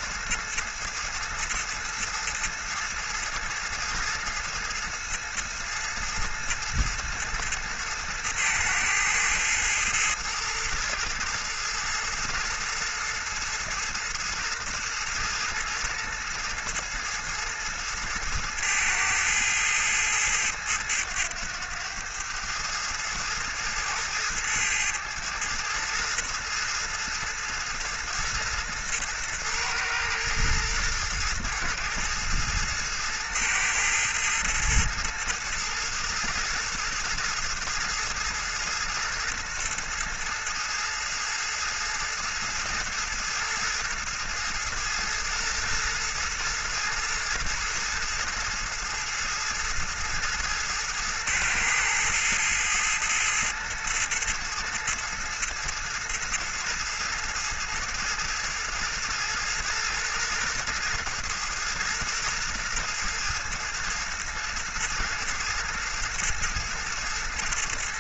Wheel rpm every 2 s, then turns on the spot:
110, 110, 110, 110, 110, 110, 110, 110, 110, 110, 110, 110, 110, 110, 110, 110, 110, 110, 110, 110, 110, 110, 110, 120, 110, 110, 110, 110, 110, 110, 110, 110, 120, 120.
none